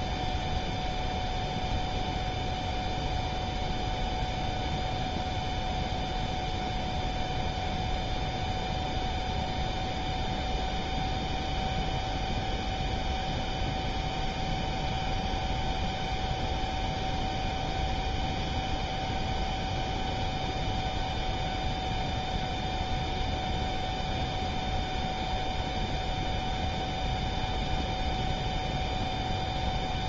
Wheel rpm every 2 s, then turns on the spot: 0, 0, 0, 0, 0, 0, 0, 0, 0, 0, 0, 0, 0, 0, 0.
none